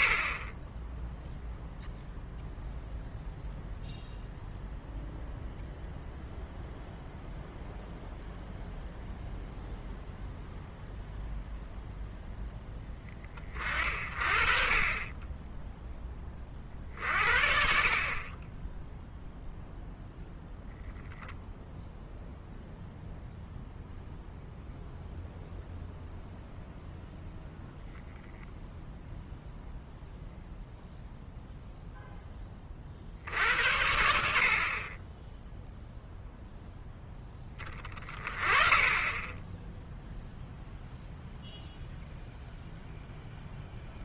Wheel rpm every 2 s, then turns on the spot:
10, 0, 0, 0, 0, 0, 10, 30, 40, 10, 0, 0, 0, 0, 0, 0, 40, 30, 0, 20, 0, 0.
none